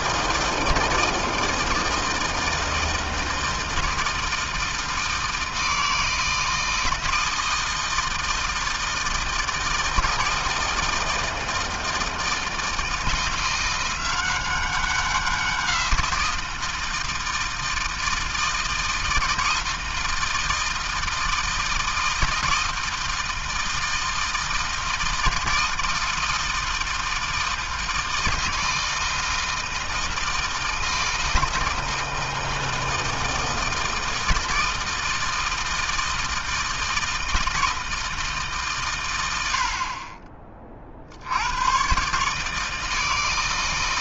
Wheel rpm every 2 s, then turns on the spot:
160, 160, 160, 160, 160, 160, 160, 190, 160, 160, 160, 160, 160, 160, 160, 160, 160, 160, 160, 120, 60, 160.
none